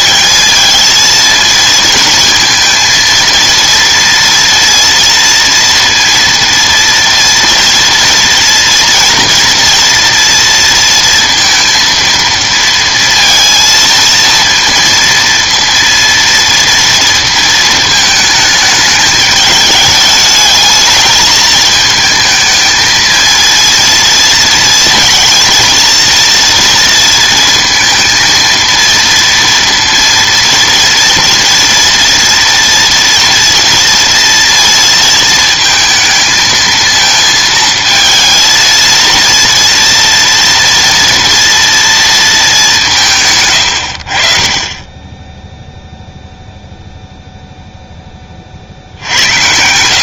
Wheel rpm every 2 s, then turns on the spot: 210, 230, 230, 230, 230, 230, 230, 230, 230, 210, 210, 220, 230, 230, 230, 230, 230, 230, 220, 230, 230, 200, 30, 0, 50.
none